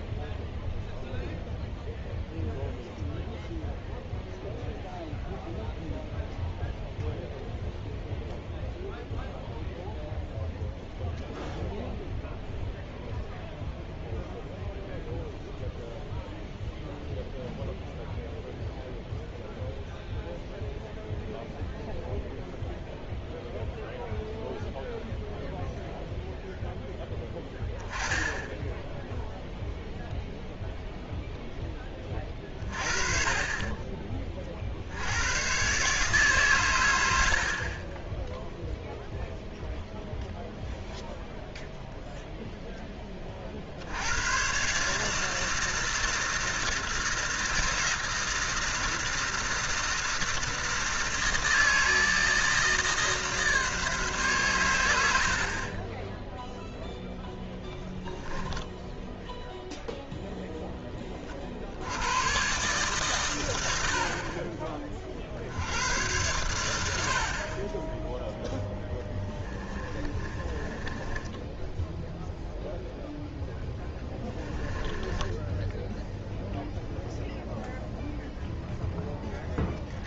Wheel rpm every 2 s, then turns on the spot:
0, 0, 0, 0, 0, 0, 0, 0, 0, 0, 0, 0, 0, 0, 10, 0, 30, 50, 130, 0, 0, 0, 120, 160, 160, 160, 150, 120, 0, 10, 0, 130, 40, 100, 10, 20, 0, 20, 0, 0.
70-72 74-76